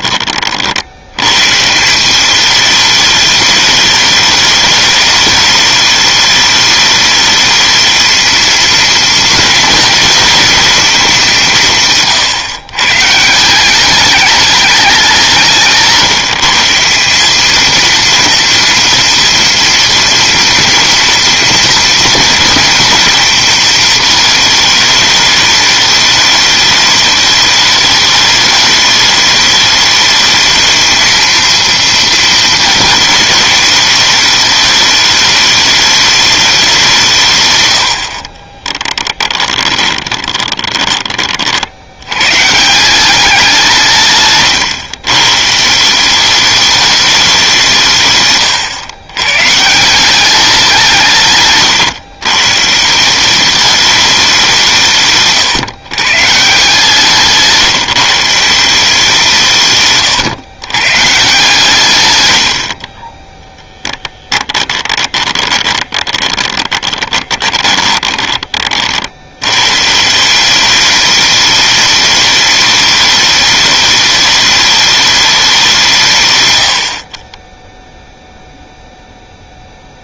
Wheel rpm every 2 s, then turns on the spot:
70, 210, 210, 210, 230, 230, 120, 200, 170, 230, 230, 230, 220, 210, 210, 220, 220, 210, 170, 20, 20, 170, 130, 200, 110, 180, 160, 150, 170, 170, 120, 50, 20, 30, 40, 200, 210, 210, 70, 0.
38-42 62-68 76-78